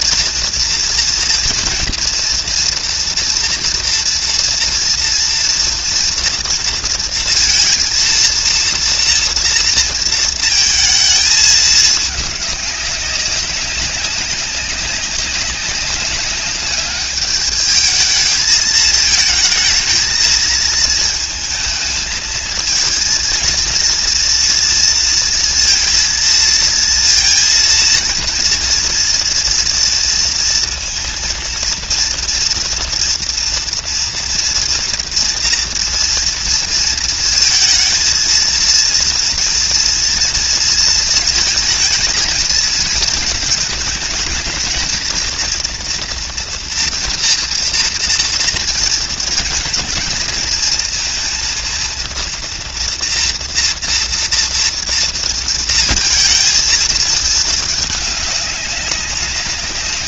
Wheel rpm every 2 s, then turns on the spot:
230, 240, 230, 230, 230, 220, 210, 200, 200, 220, 220, 220, 230, 230, 230, 230, 230, 230, 230, 230, 230, 220, 220, 230, 230, 230, 230, 230, 230, 200.
none